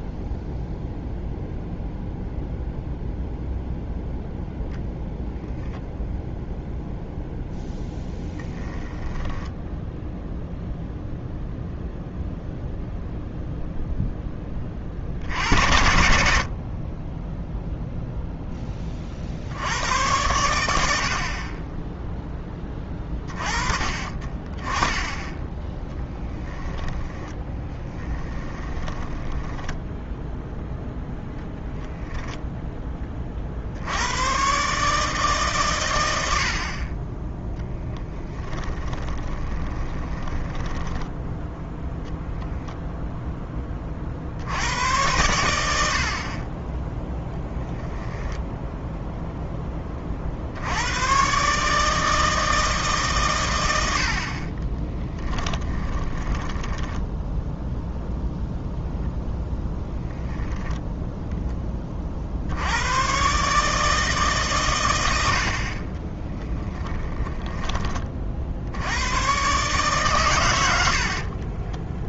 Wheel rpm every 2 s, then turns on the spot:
0, 0, 0, 0, 10, 0, 0, 30, 30, 20, 80, 20, 20, 10, 20, 0, 10, 150, 30, 30, 10, 0, 100, 10, 0, 90, 150, 20, 10, 0, 0, 90, 110, 10, 80, 90.
8-10 26-30 38-42 54-58 66-68 70-72